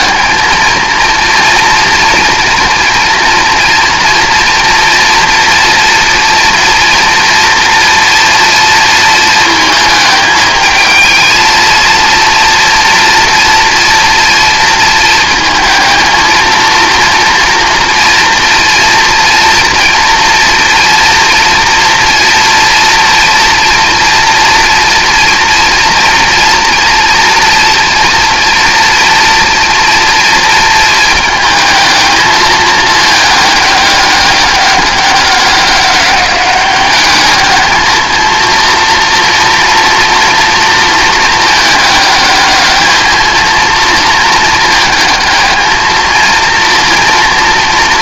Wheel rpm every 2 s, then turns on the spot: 230, 230, 230, 230, 230, 220, 230, 230, 230, 230, 240, 230, 240, 240, 230, 230, 220, 200, 200, 230, 230, 210, 220, 230.
none